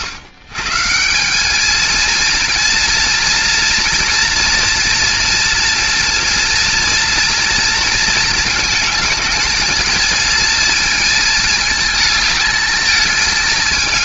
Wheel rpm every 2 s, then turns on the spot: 150, 230, 230, 240, 220, 230, 220.
none